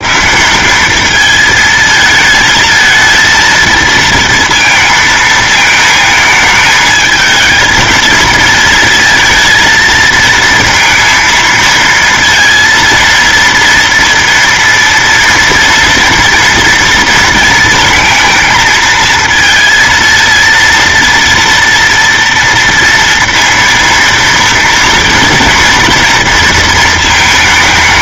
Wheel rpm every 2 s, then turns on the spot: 200, 220, 230, 220, 220, 230, 230, 230, 230, 230, 230, 230, 230, 230.
none